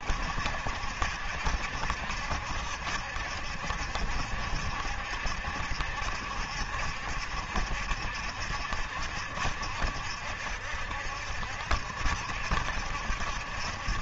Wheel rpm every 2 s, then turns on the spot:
70, 70, 70, 70, 70, 70, 70.
none